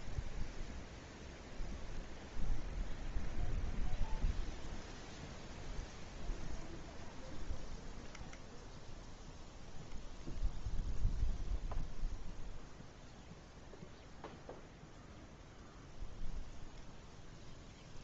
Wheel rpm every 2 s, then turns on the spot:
0, 0, 0, 0, 0, 0, 0, 0, 0.
none